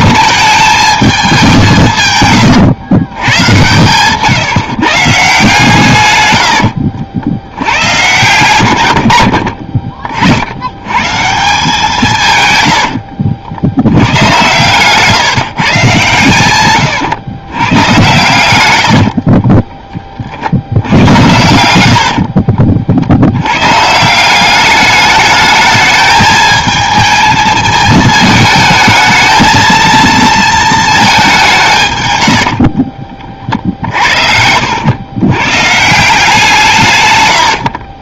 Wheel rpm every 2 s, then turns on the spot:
220, 120, 150, 90, 110, 100, 120, 120, 120, 80, 70, 50, 200, 220, 220, 220, 50, 90, 150.
6-8 16-20 32-34